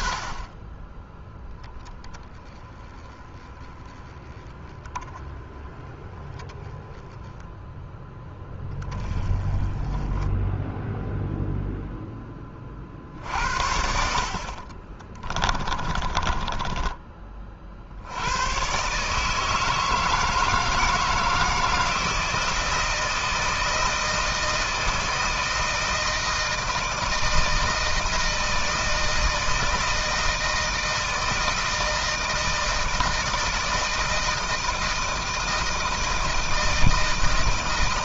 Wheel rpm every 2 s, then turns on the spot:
30, 20, 10, 10, 20, 0, 40, 40, 30, 140, 160, 160, 160, 160, 160, 160, 160, 160, 160.
14-16